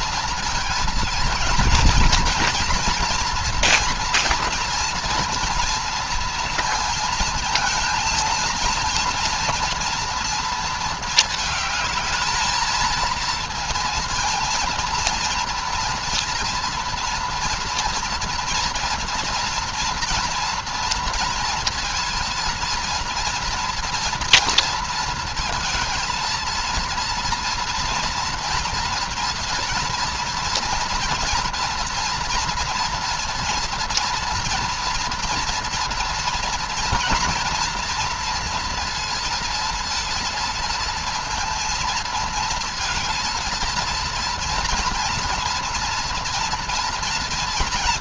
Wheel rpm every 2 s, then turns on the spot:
230, 240, 230, 230, 230, 220, 230, 220, 230, 230, 230, 230, 230, 230, 230, 230, 240, 230, 240, 230, 230, 230, 230, 230.
none